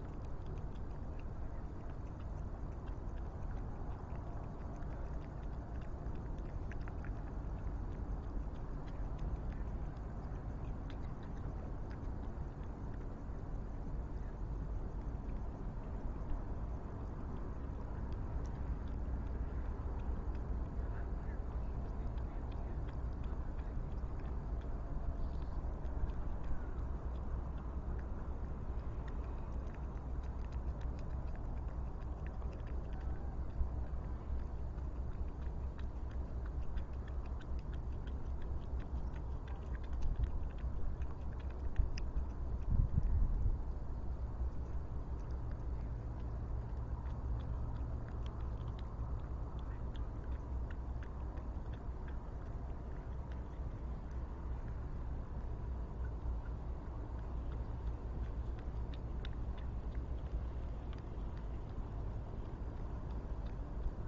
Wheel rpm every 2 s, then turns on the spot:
0, 0, 0, 0, 0, 0, 0, 0, 0, 0, 0, 0, 0, 0, 0, 0, 0, 0, 0, 0, 0, 0, 0, 0, 0, 0, 0, 0, 0, 0, 0, 0.
none